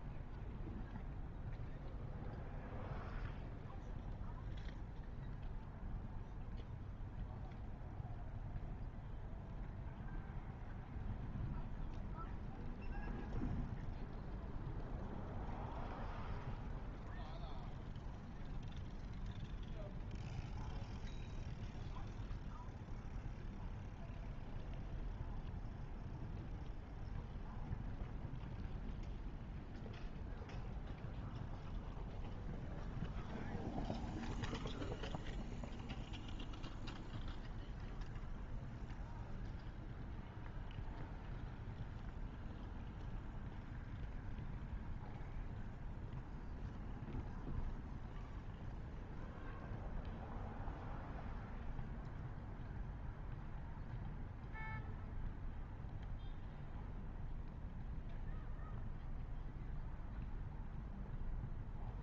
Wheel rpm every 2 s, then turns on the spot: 0, 0, 0, 0, 0, 0, 0, 0, 0, 0, 0, 0, 0, 0, 0, 0, 0, 0, 0, 0, 0, 0, 0, 0, 0, 0, 0, 0, 0, 0, 0.
none